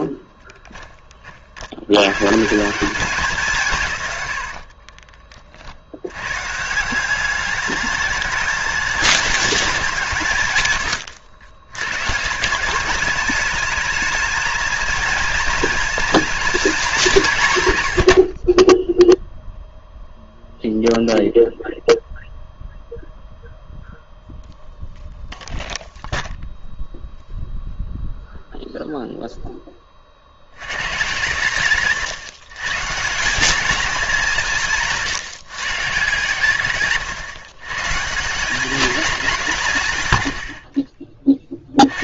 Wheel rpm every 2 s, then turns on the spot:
10, 180, 40, 160, 210, 120, 190, 230, 200, 10, 0, 0, 0, 0, 0, 110, 150, 170, 150, 200, 50.
4-6